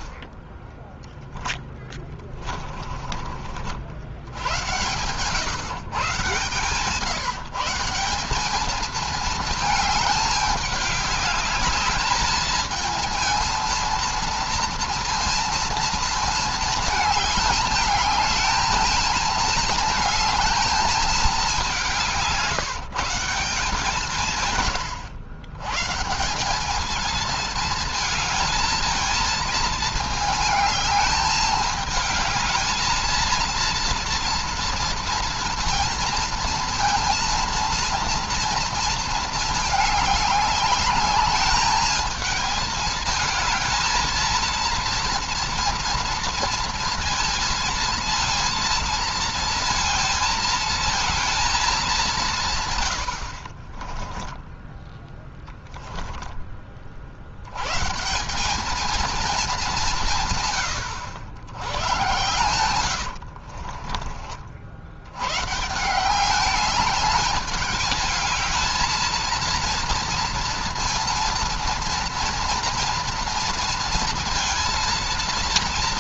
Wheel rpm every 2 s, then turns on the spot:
20, 30, 90, 140, 200, 210, 220, 230, 220, 220, 220, 160, 140, 170, 220, 220, 210, 230, 230, 230, 200, 220, 230, 230, 230, 230, 160, 10, 20, 190, 140, 110, 50, 180, 220, 230, 230, 230.
0-4 62-64